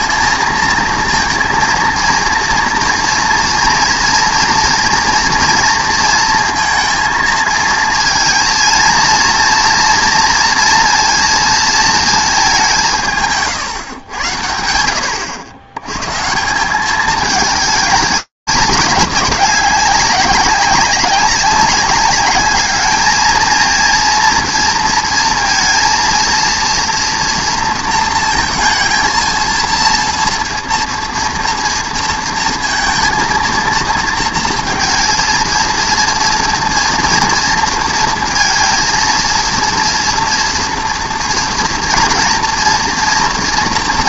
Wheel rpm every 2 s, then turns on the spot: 230, 230, 230, 230, 230, 230, 190, 80, 180, 200, 200, 210, 230, 230, 230, 230, 230, 230, 230, 230, 240, 240.
none